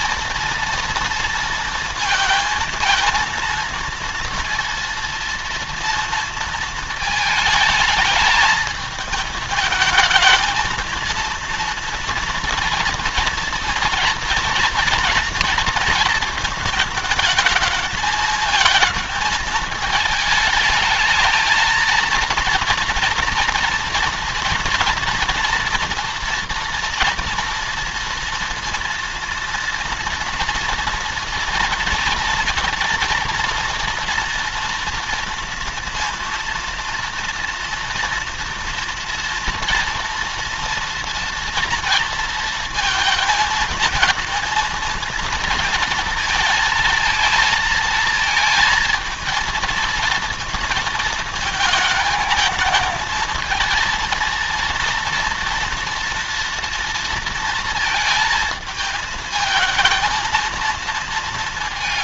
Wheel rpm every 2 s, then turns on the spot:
230, 230, 230, 220, 220, 230, 230, 230, 220, 220, 220, 240, 230, 240, 230, 240, 240, 230, 230, 240, 230, 230, 230, 230, 230, 230, 220, 230, 230, 220, 230.
none